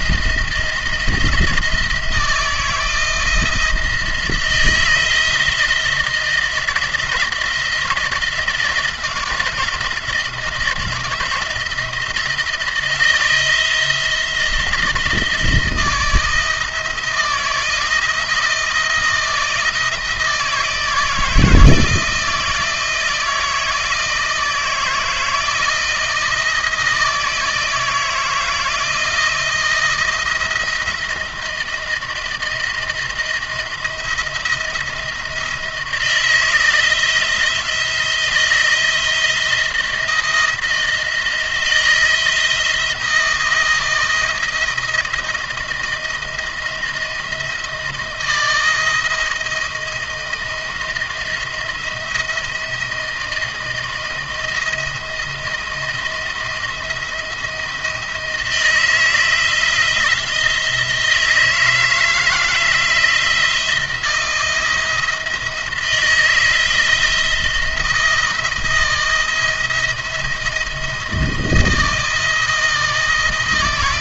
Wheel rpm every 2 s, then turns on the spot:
170, 160, 170, 160, 170, 160, 160, 170, 170, 170, 160, 170, 160, 160, 170, 170, 170, 170, 160, 170, 170, 160, 170, 170, 170, 170, 170, 170, 170, 160, 160, 160, 170, 170, 170, 170, 160.
none